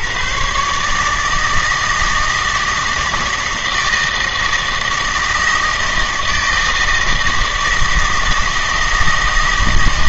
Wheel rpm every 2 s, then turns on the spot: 140, 160, 160, 160, 160.
none